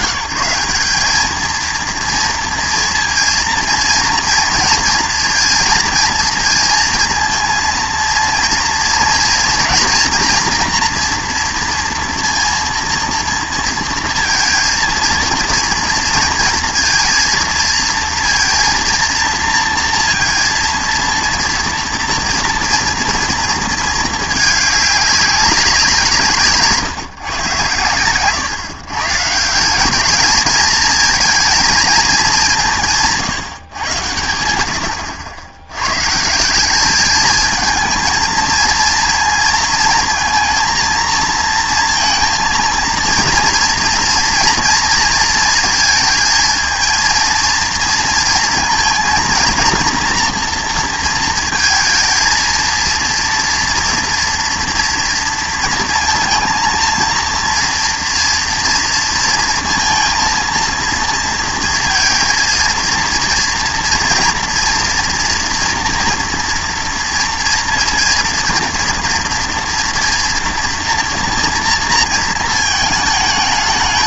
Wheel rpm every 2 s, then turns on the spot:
200, 230, 230, 230, 230, 240, 230, 230, 230, 230, 230, 230, 210, 150, 140, 220, 190, 80, 180, 220, 230, 230, 230, 220, 230, 240, 230, 230, 230, 240, 230, 230, 230, 240, 230, 240, 230.
none